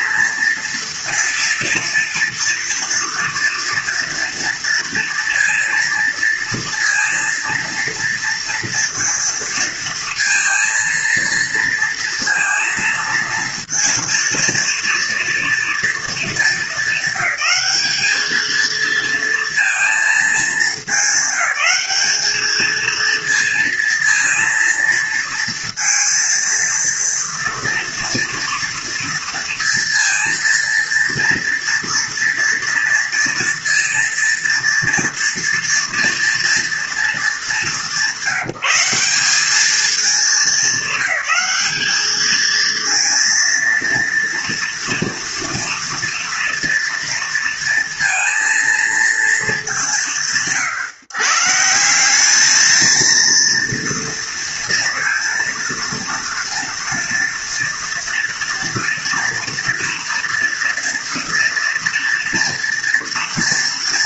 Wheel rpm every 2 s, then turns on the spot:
230, 230, 230, 230, 230, 230, 230, 230, 200, 230, 220, 230, 230, 230, 230, 230, 230, 230, 230, 190, 200, 230, 230, 230, 230, 130, 220, 230, 230, 230, 230, 230.
none